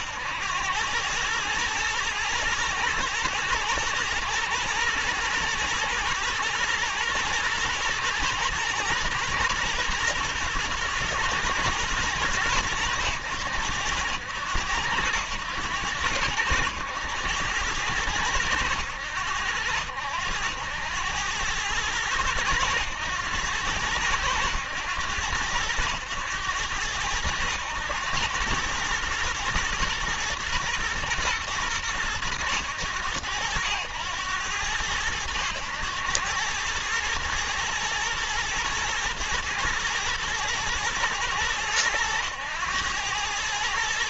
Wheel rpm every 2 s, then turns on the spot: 100, 110, 110, 120, 110, 120, 100, 90, 100, 100, 90, 110, 100, 110, 110, 120, 80, 100, 110, 120, 120, 110.
none